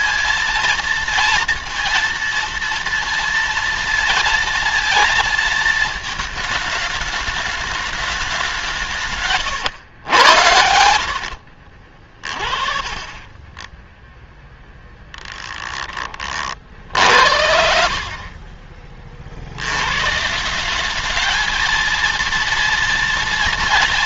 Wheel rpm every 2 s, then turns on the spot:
230, 230, 230, 220, 170, 80, 30, 10, 50, 40, 180, 230.
12-14 18-20